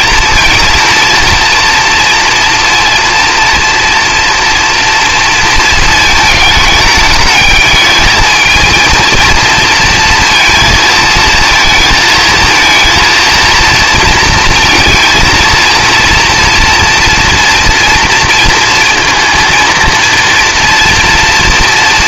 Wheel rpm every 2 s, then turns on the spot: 230, 230, 230, 210, 230, 230, 230, 230, 230, 230, 230.
none